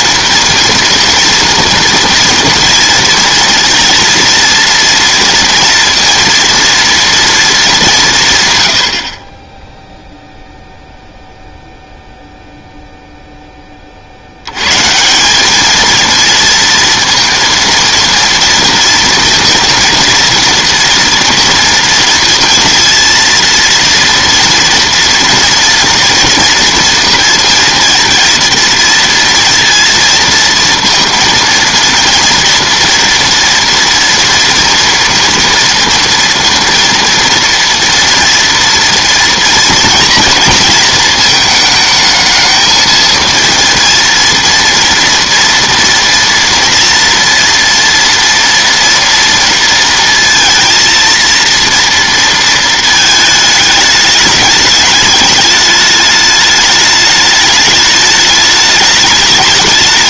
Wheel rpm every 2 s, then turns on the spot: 230, 230, 230, 230, 100, 0, 0, 120, 230, 230, 230, 230, 230, 230, 230, 230, 230, 230, 230, 230, 230, 220, 230, 240, 230, 230, 230, 210, 210, 210.
none